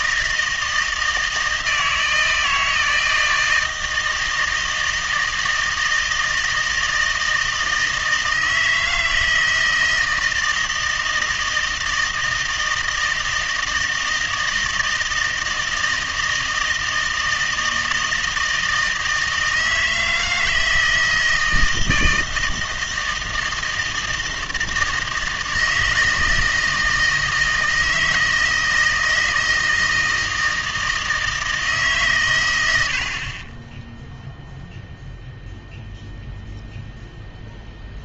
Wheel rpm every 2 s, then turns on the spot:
160, 160, 160, 160, 160, 160, 160, 160, 160, 160, 160, 160, 160, 160, 160, 160, 90, 0, 0.
none